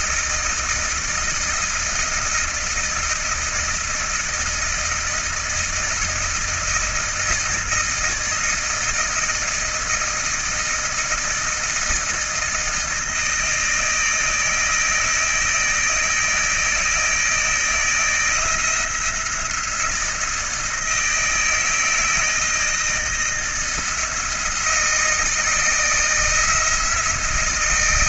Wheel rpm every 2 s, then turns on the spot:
160, 160, 160, 160, 160, 160, 160, 160, 160, 170, 160, 160, 160, 170.
none